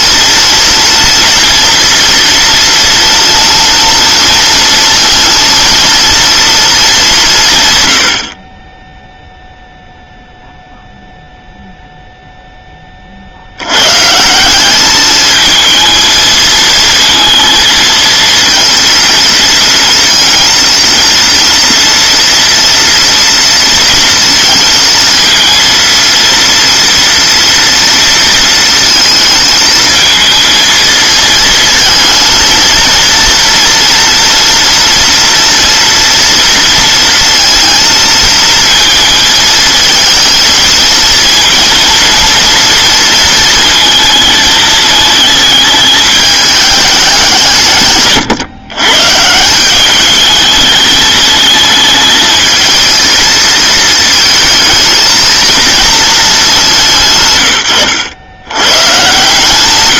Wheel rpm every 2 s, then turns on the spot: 230, 230, 230, 230, 50, 0, 20, 210, 230, 230, 230, 230, 230, 230, 230, 230, 230, 230, 230, 230, 230, 230, 220, 210, 130, 210, 220, 220, 180, 130.
none